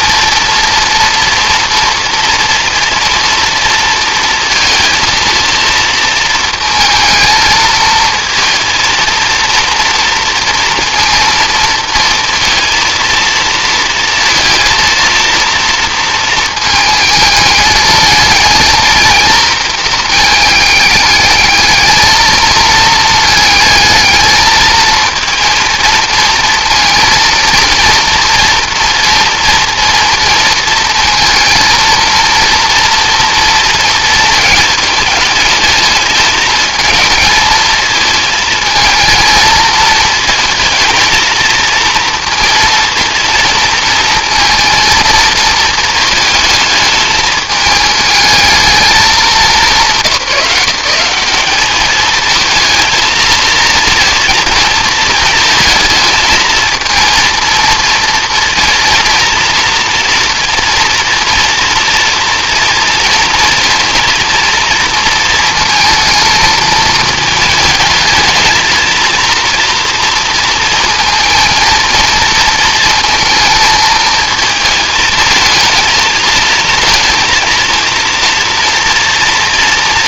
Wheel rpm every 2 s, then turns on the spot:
230, 230, 230, 220, 230, 230, 230, 230, 220, 230, 210, 220, 220, 230, 230, 230, 230, 220, 220, 220, 230, 230, 230, 220, 210, 180, 220, 230, 230, 230, 230, 230, 230, 220, 230, 230, 230, 220, 230, 230.
none